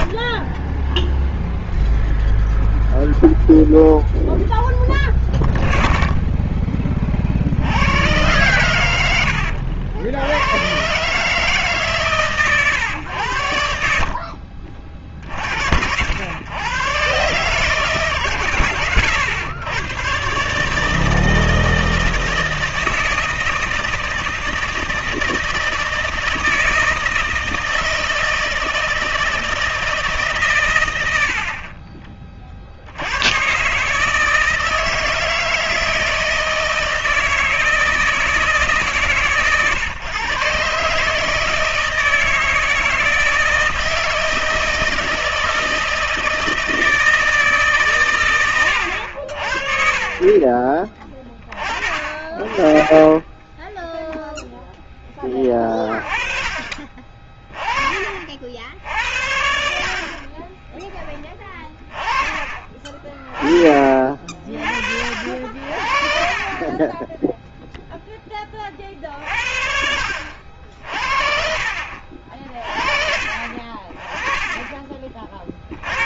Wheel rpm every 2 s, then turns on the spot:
0, 0, 0, 20, 100, 110, 120, 50, 120, 120, 150, 160, 160, 160, 160, 120, 50, 160, 160, 150, 140, 160, 160, 160, 100, 30, 20, 10, 20, 60, 20, 20, 50, 20, 30, 70, 40, 20.
60-62